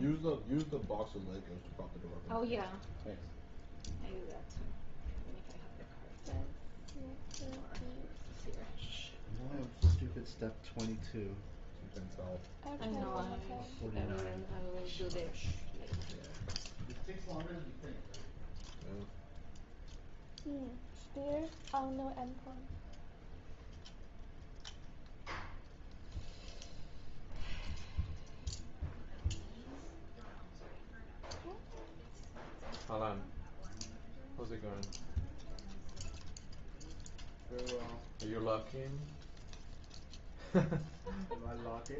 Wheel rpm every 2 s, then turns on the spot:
0, 0, 0, 0, 0, 0, 0, 0, 0, 0, 0, 0, 0, 0, 0, 0, 0, 0, 0, 0, 0.
none